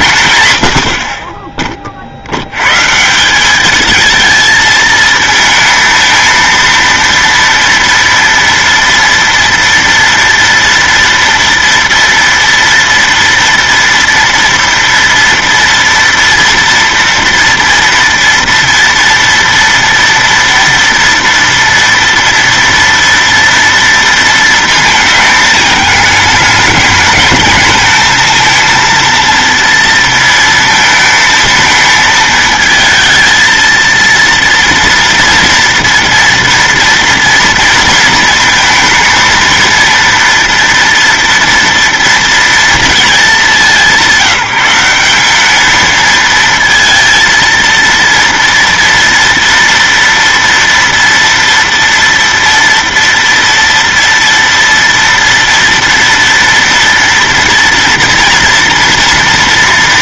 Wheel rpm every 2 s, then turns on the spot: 90, 110, 220, 230, 230, 230, 230, 230, 230, 230, 230, 230, 230, 220, 230, 230, 220, 230, 240, 230, 230, 230, 190, 230, 230, 230, 230, 230, 230, 230.
none